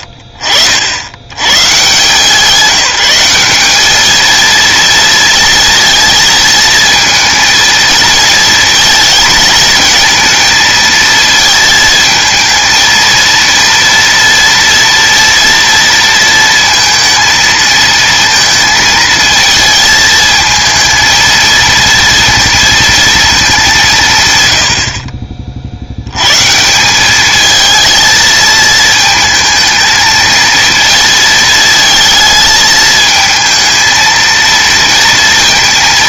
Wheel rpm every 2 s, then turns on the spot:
60, 190, 230, 230, 220, 220, 220, 230, 230, 220, 220, 230, 100, 170, 220, 230, 220, 230.
none